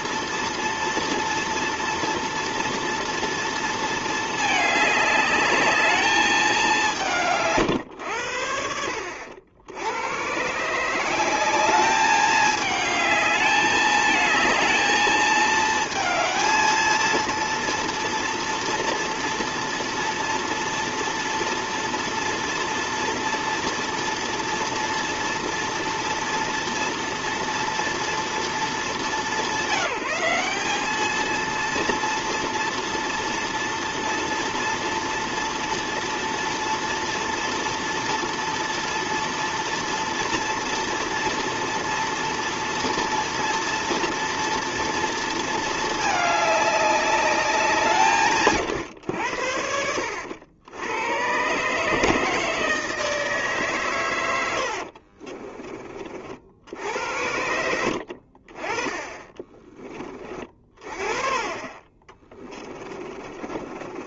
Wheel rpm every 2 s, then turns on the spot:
230, 230, 220, 210, 100, 110, 210, 220, 220, 230, 230, 230, 230, 230, 230, 200, 230, 230, 230, 230, 230, 230, 230, 210, 150, 80, 150, 100, 50, 60, 30, 20.
62-64